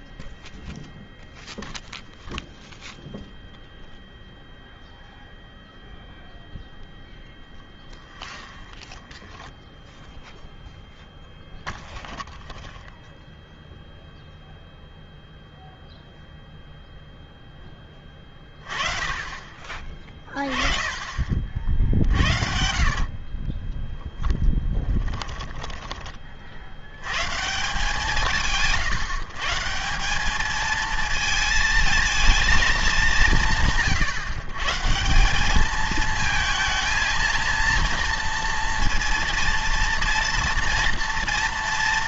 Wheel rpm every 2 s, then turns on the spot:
0, 0, 0, 0, 0, 0, 0, 0, 0, 20, 30, 60, 20, 70, 150, 220, 220, 140, 220, 230, 230.
22-26